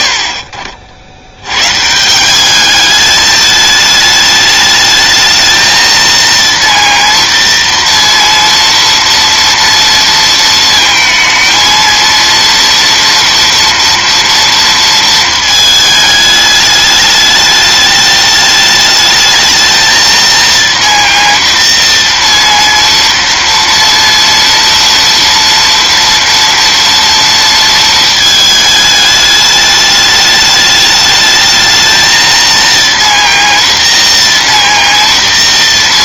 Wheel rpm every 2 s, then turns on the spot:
70, 200, 220, 230, 230, 230, 230, 230, 210, 210, 230, 230, 230, 230, 220, 210, 230, 230.
none